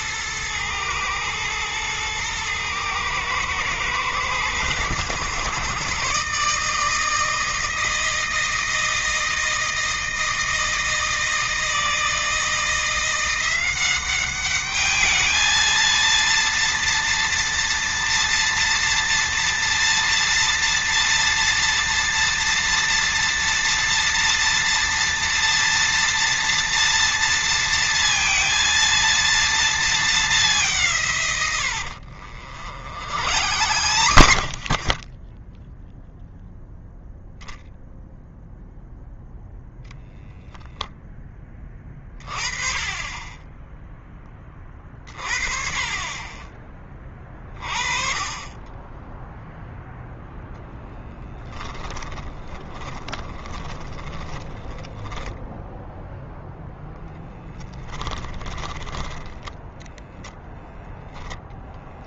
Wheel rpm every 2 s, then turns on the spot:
110, 110, 120, 160, 160, 160, 170, 210, 240, 230, 230, 240, 230, 230, 230, 150, 60, 30, 0, 0, 10, 20, 30, 30, 20, 10, 10, 10, 0, 10, 0.
32-36 50-56 58-60